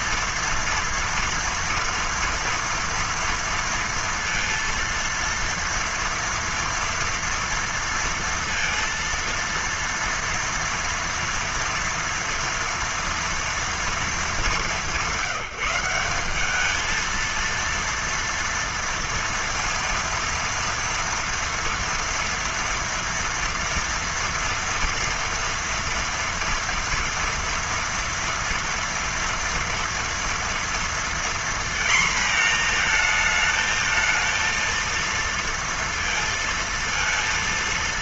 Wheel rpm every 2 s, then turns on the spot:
230, 230, 230, 230, 230, 230, 230, 200, 200, 230, 230, 230, 230, 230, 230, 240, 230, 230, 230.
none